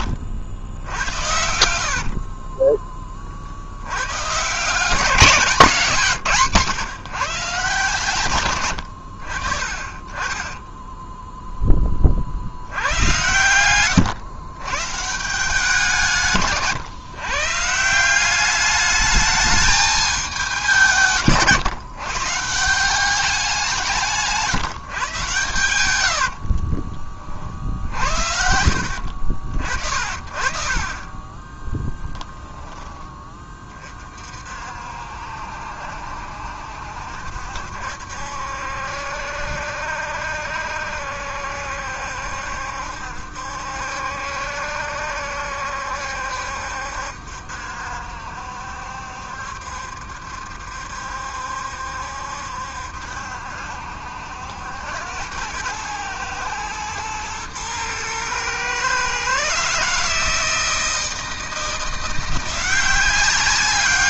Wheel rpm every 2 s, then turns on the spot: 80, 20, 150, 160, 110, 10, 80, 130, 140, 200, 180, 170, 150, 40, 70, 40, 10, 60, 70, 70, 70, 70, 70, 70, 70, 70, 70, 80, 110, 120, 160, 180.
2-4 10-12 16-18 26-32